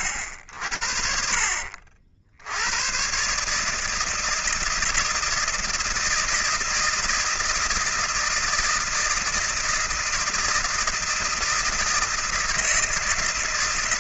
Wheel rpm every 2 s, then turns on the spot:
80, 110, 160, 160, 160, 160, 160.
none